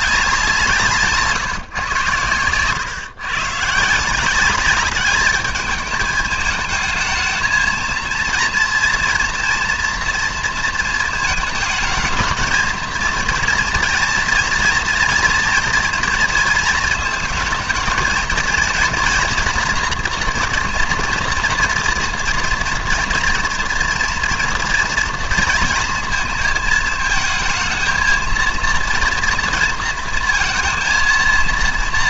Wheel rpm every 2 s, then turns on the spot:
170, 120, 200, 220, 230, 230, 230, 240, 230, 220, 230, 240, 240, 220, 230, 230.
none